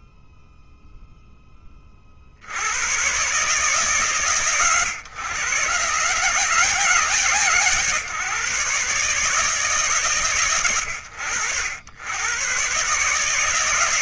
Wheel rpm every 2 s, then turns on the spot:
10, 120, 120, 120, 140, 90, 160.
none